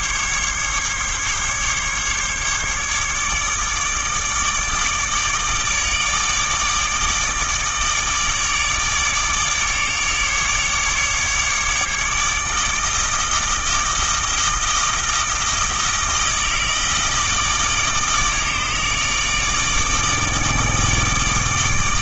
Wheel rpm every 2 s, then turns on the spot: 140, 150, 150, 150, 150, 150, 160, 160, 160, 160, 160.
none